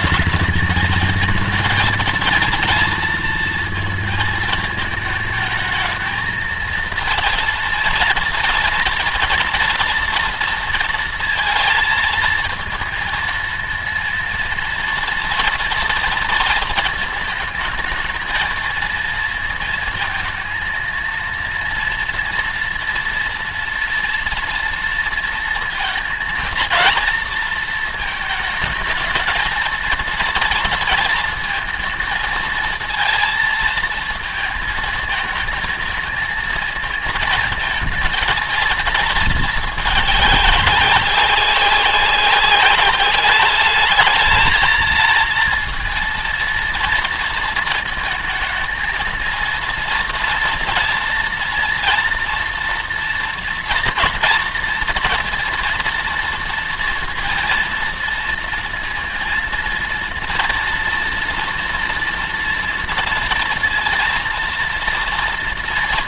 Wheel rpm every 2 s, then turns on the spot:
220, 230, 230, 230, 230, 230, 230, 230, 230, 220, 230, 230, 230, 230, 220, 230, 220, 220, 220, 230, 200, 200, 230, 230, 220, 230, 230, 230, 230, 230, 240, 230, 230.
none